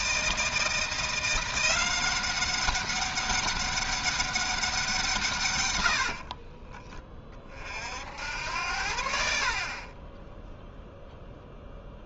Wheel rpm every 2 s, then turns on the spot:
170, 200, 190, 30, 80, 0.
6-8